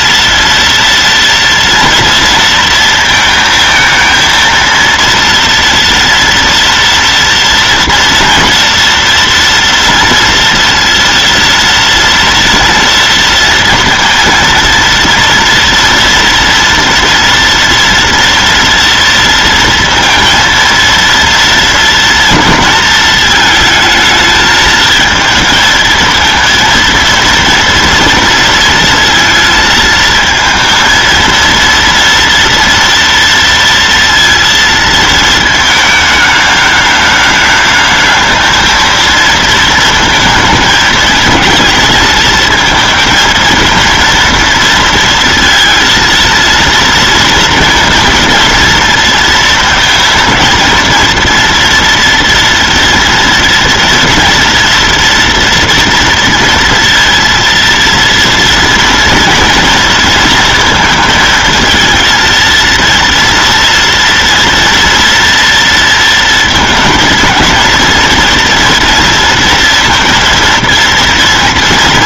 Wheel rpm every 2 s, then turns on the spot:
230, 230, 230, 230, 230, 230, 230, 230, 230, 230, 230, 230, 220, 230, 230, 220, 230, 230, 210, 220, 220, 220, 230, 230, 230, 230, 230, 230, 230, 230, 230, 230, 230, 230, 230, 230.
none